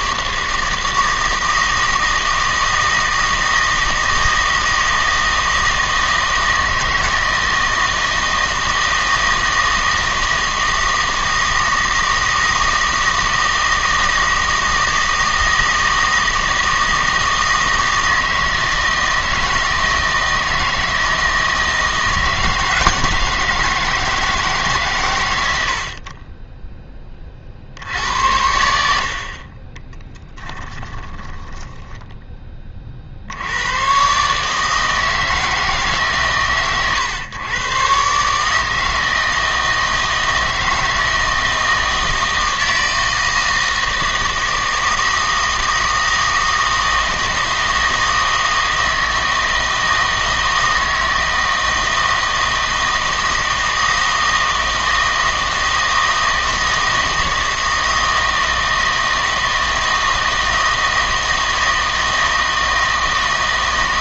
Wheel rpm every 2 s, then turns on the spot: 160, 160, 160, 160, 160, 160, 160, 160, 160, 160, 160, 160, 140, 10, 70, 10, 30, 150, 130, 160, 160, 160, 160, 160, 160, 160, 160, 160, 160, 160, 160, 160.
30-32